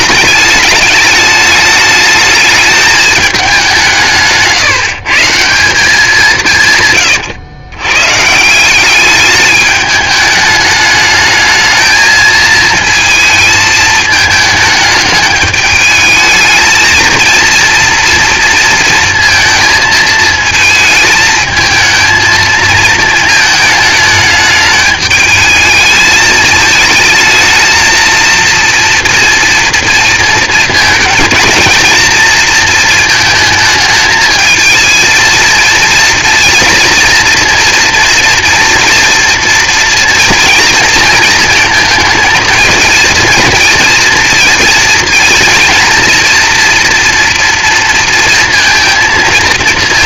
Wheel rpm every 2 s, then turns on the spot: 210, 220, 160, 160, 170, 210, 230, 220, 220, 230, 220, 220, 210, 220, 230, 230, 230, 220, 230, 230, 230, 230, 230, 230, 230.
none